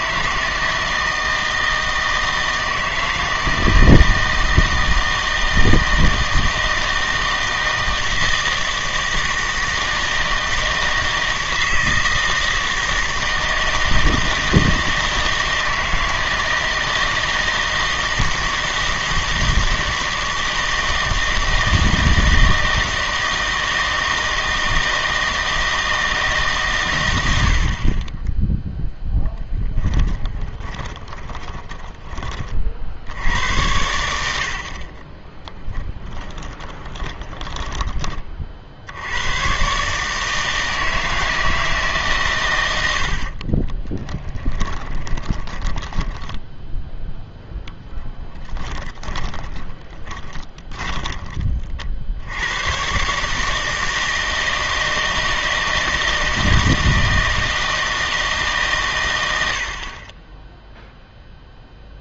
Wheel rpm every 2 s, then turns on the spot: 160, 160, 160, 160, 160, 160, 160, 160, 160, 160, 160, 160, 160, 130, 0, 20, 50, 60, 10, 50, 160, 110, 20, 10, 20, 20, 110, 160, 160, 150, 10.
30-32 36-38 44-52